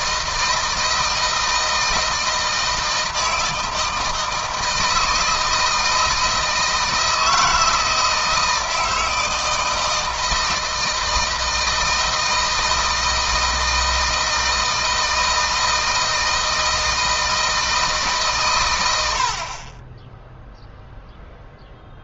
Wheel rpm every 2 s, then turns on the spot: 160, 160, 160, 160, 160, 160, 160, 160, 160, 90, 0.
none